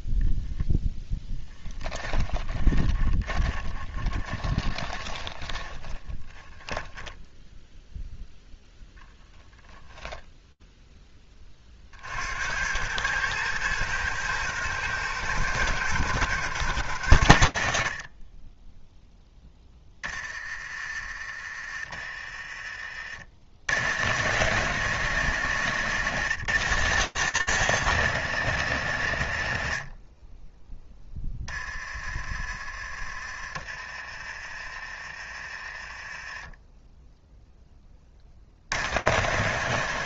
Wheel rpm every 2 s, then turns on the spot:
0, 10, 20, 20, 0, 0, 90, 110, 110, 10, 30, 40, 120, 120, 100, 10, 30, 30, 0, 90.
2-8 22-24